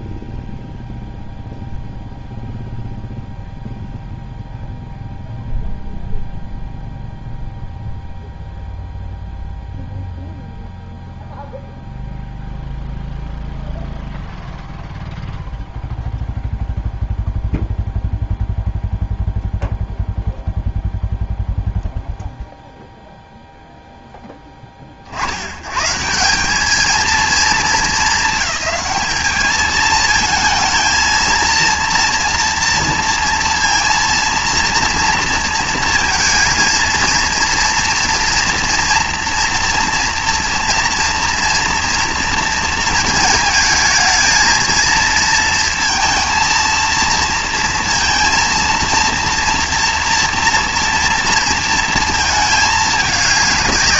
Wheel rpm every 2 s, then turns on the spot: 0, 0, 0, 0, 0, 0, 0, 0, 0, 0, 0, 0, 30, 210, 220, 220, 230, 230, 230, 230, 230, 230, 230, 230, 230, 230, 220.
none